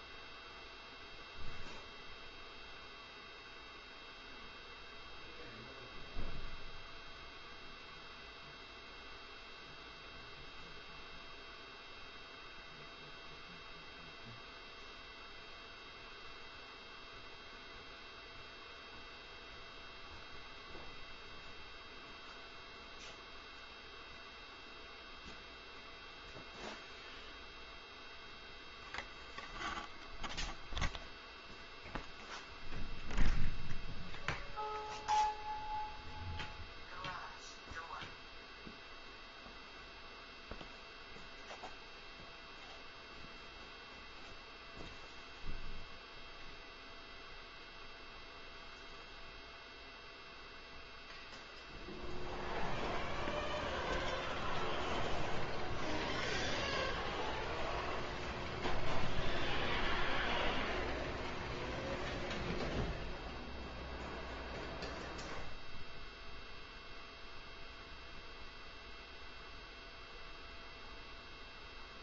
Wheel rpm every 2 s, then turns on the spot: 0, 0, 0, 0, 0, 0, 0, 0, 0, 0, 0, 0, 0, 0, 0, 0, 0, 0, 0, 0, 0, 0, 0, 0, 0, 0, 0, 0, 0, 0, 0, 0, 0, 0, 0, 0.
none